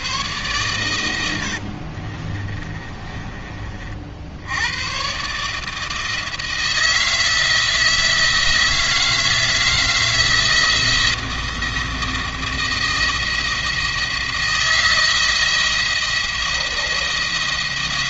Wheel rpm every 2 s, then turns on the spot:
100, 30, 120, 160, 160, 160, 170, 170, 170.
0-4